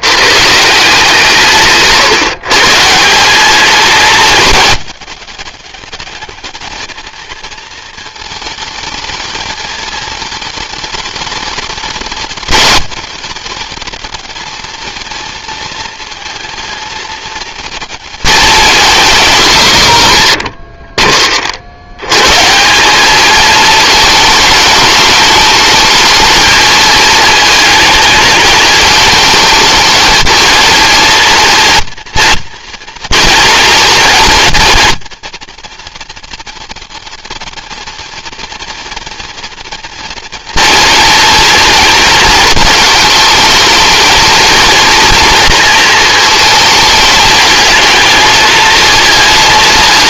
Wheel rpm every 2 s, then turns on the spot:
160, 160, 210, 220, 220, 210, 210, 230, 230, 220, 30, 180, 220, 220, 220, 230, 230, 230, 230, 240, 240, 220, 230, 220, 220.
none